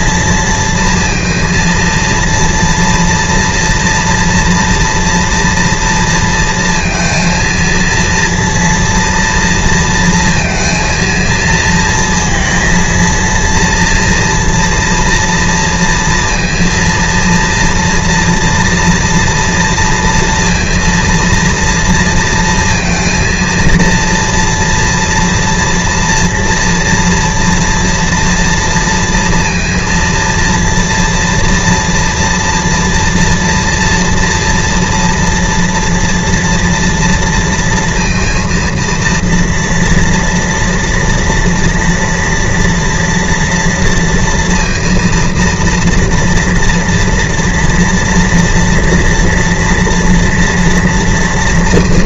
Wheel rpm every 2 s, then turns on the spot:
230, 230, 240, 230, 230, 230, 230, 230, 230, 230, 230, 230, 230, 230, 230, 230, 240, 240, 230, 230, 230, 230, 230, 230, 230, 230.
none